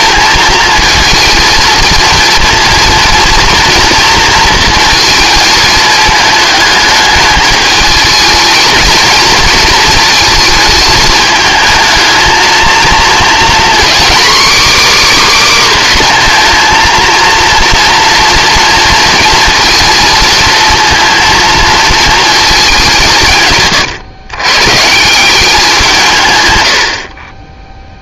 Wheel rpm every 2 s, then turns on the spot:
220, 230, 230, 210, 230, 220, 230, 290, 230, 230, 230, 200, 140, 80.
none